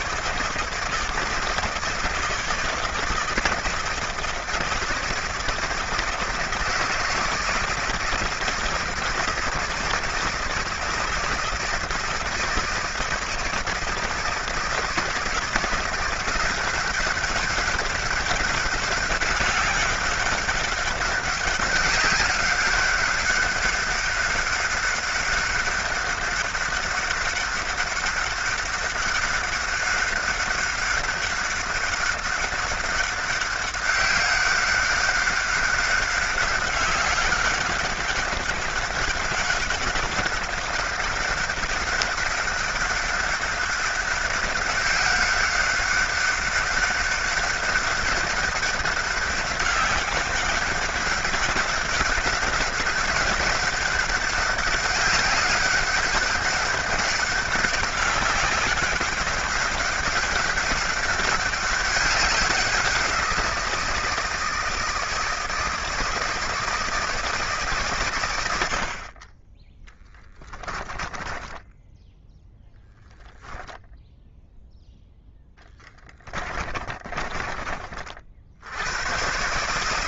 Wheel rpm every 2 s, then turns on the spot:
160, 160, 160, 160, 160, 160, 160, 160, 170, 200, 200, 200, 200, 200, 200, 200, 200, 190, 200, 200, 190, 200, 190, 190, 200, 190, 190, 190, 190, 190, 190, 190, 160, 160, 90, 20, 0, 0, 30, 80.
70-72 76-78